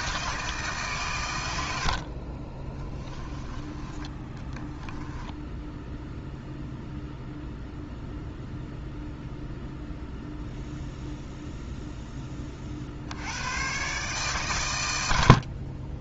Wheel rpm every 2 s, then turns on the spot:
130, 20, 10, 0, 0, 0, 60, 90.
2-6